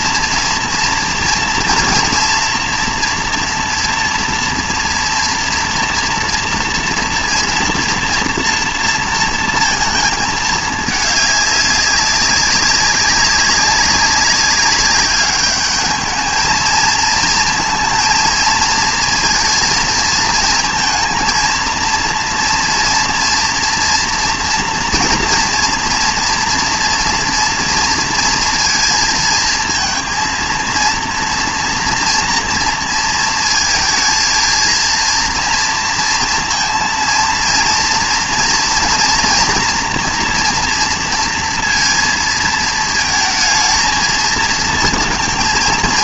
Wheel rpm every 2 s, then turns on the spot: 230, 240, 230, 230, 230, 210, 200, 190, 220, 230, 220, 230, 230, 230, 230, 230, 230, 230, 230, 230, 230, 230, 230.
none